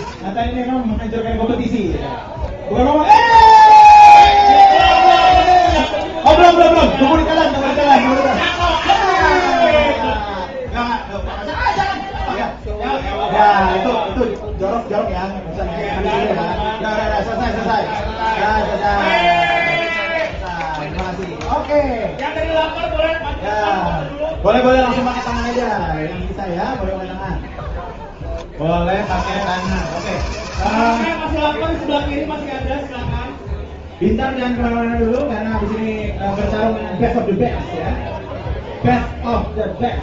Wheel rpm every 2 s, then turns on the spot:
20, 10, 80, 20, 110, 10, 0, 0, 0, 0, 0, 10, 40, 10, 50, 90, 10, 10, 10, 0.
0-4 10-12 22-24 26-28 32-38